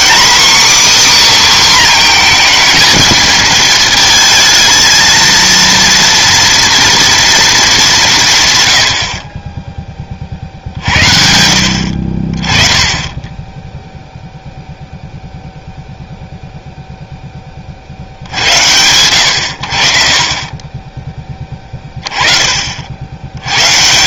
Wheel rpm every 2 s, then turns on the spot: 280, 220, 230, 230, 50, 60, 20, 0, 0, 90, 30, 30.
none